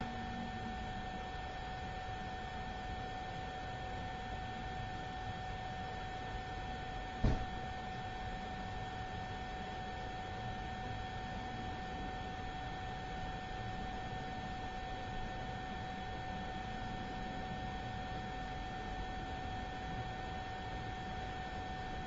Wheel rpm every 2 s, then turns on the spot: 0, 0, 0, 0, 0, 0, 0, 0, 0, 0, 0.
none